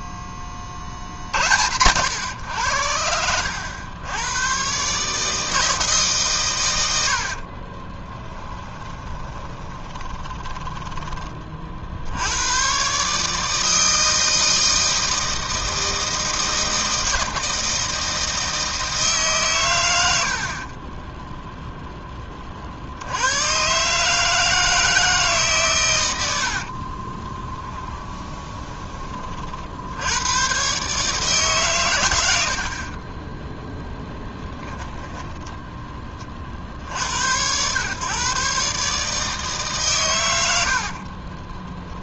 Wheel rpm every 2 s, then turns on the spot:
40, 90, 130, 100, 20, 20, 130, 160, 160, 160, 30, 50, 160, 50, 30, 130, 50, 20, 50, 140, 90.
6-12 20-22 26-28 34-36